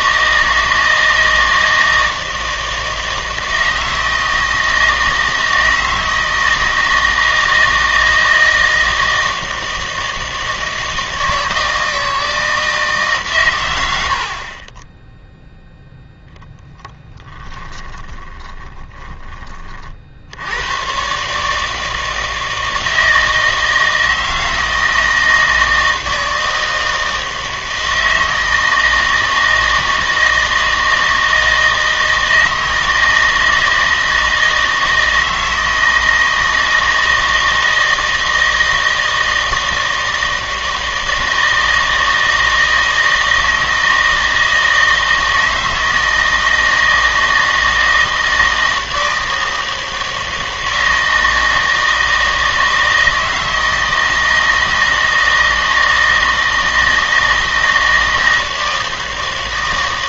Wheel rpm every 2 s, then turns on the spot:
160, 160, 160, 160, 160, 160, 160, 20, 20, 10, 110, 160, 160, 160, 160, 160, 160, 160, 160, 160, 160, 160, 160, 160, 160, 160, 160, 160, 160, 160.
16-20